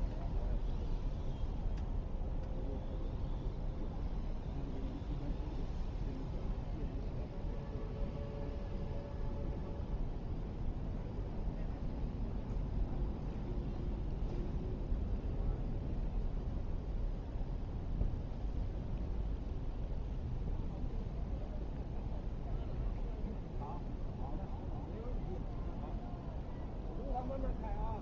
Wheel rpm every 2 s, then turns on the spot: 0, 0, 0, 0, 0, 0, 0, 0, 0, 0, 0, 0, 0, 0.
none